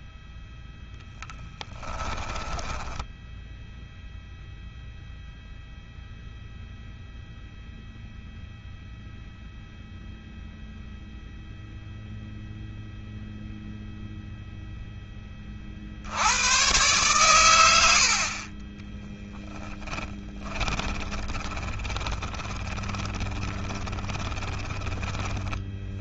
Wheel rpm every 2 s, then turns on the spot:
0, 10, 0, 0, 0, 0, 0, 10, 110, 10, 20, 20, 10.
2-4 18-26